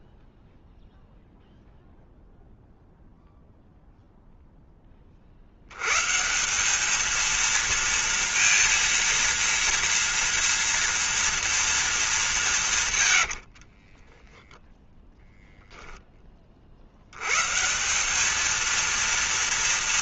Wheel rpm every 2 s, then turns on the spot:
0, 0, 110, 230, 230, 220, 60, 10, 170, 230.
12-14